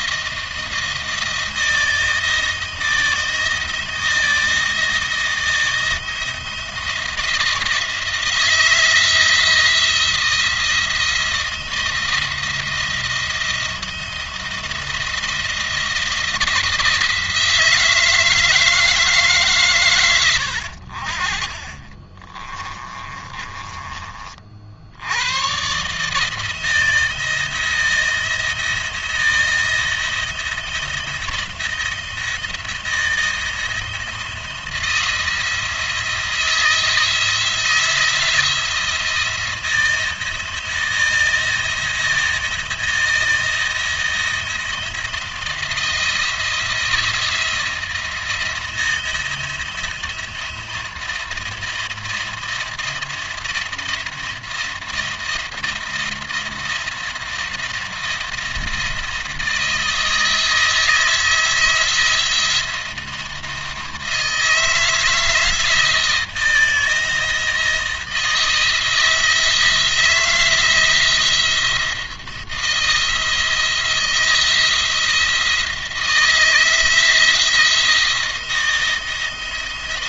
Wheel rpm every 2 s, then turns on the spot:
170, 160, 160, 170, 160, 160, 170, 170, 170, 160, 70, 30, 60, 160, 170, 170, 170, 170, 160, 170, 170, 170, 170, 170, 170, 170, 170, 170, 170, 160, 160, 170, 160, 170, 160, 170, 160, 170, 170, 170.
22-24